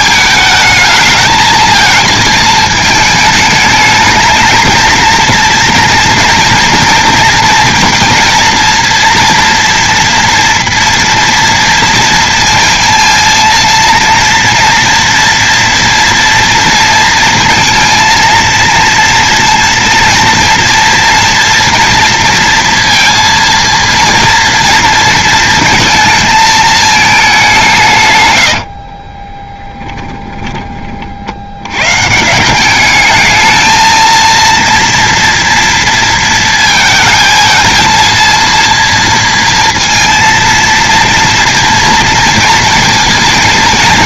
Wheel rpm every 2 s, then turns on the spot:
210, 220, 220, 230, 230, 240, 230, 230, 230, 230, 230, 230, 230, 220, 80, 20, 190, 230, 220, 230, 230, 230.
28-30